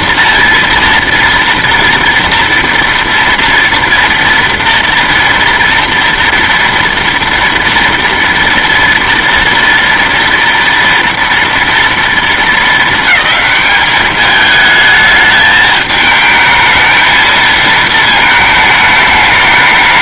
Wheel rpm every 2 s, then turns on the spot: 230, 230, 230, 230, 230, 230, 220, 210, 220, 220.
none